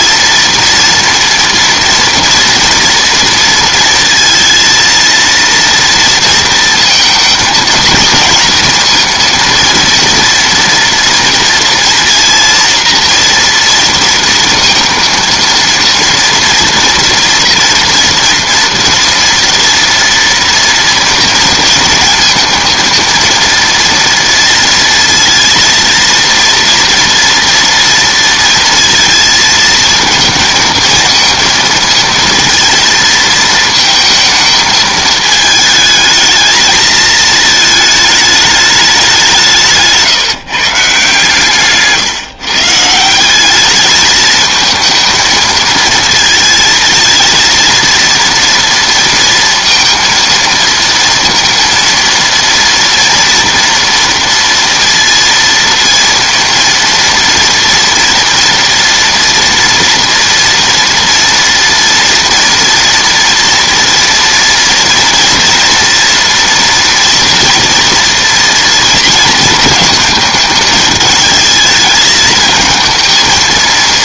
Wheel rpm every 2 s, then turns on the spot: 230, 230, 230, 230, 230, 230, 230, 230, 230, 230, 230, 230, 230, 230, 230, 230, 230, 220, 220, 210, 140, 150, 220, 220, 230, 230, 230, 230, 230, 230, 230, 230, 230, 230, 230, 210, 220.
none